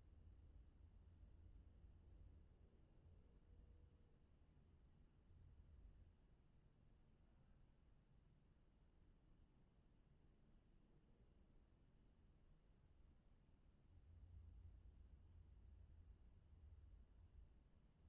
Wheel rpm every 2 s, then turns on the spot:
0, 0, 0, 0, 0, 0, 0, 0, 0.
none